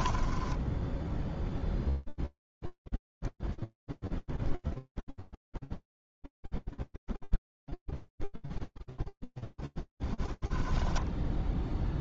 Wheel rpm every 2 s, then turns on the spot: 0, 10, 0, 0, 0, 0.
none